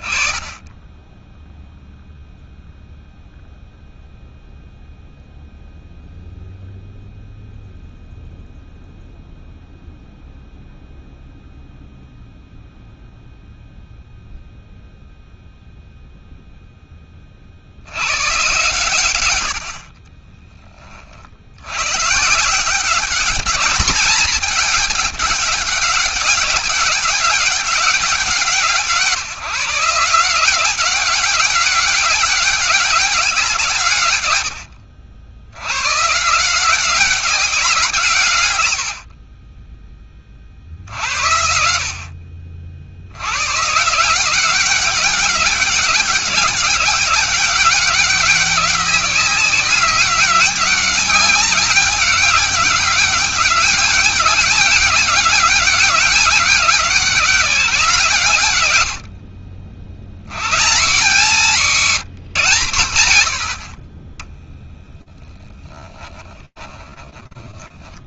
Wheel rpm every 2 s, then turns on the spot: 20, 0, 0, 0, 0, 0, 0, 0, 20, 120, 30, 180, 210, 190, 170, 180, 200, 80, 170, 100, 40, 60, 180, 200, 190, 190, 200, 200, 200, 130, 120, 150, 10, 20.
64-68